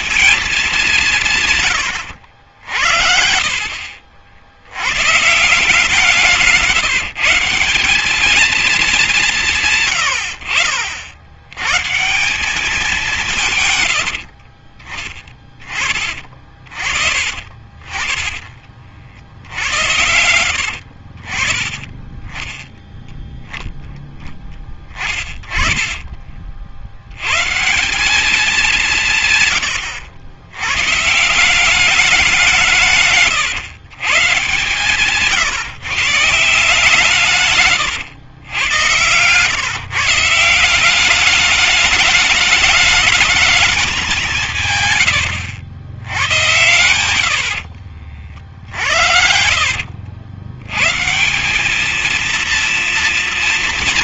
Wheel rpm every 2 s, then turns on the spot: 200, 70, 80, 160, 220, 80, 180, 60, 40, 50, 90, 20, 20, 40, 190, 100, 170, 130, 150, 100, 170, 220, 170, 100, 50, 90, 230.
18-22 24-26 48-50